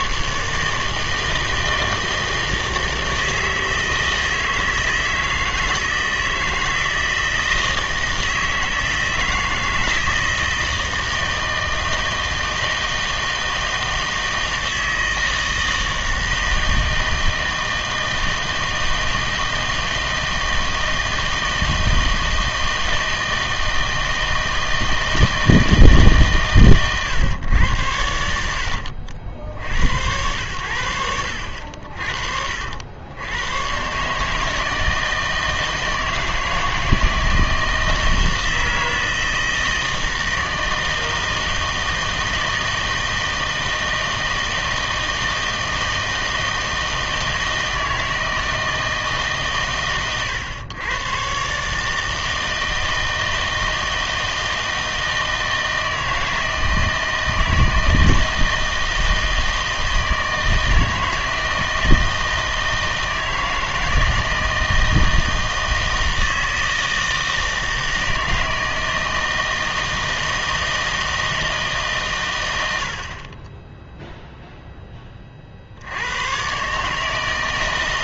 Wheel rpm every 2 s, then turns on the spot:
150, 160, 160, 160, 160, 160, 160, 160, 160, 160, 160, 160, 160, 130, 70, 90, 70, 150, 160, 160, 160, 160, 160, 160, 160, 110, 160, 160, 160, 160, 160, 160, 160, 160, 160, 160, 90, 0, 140.
none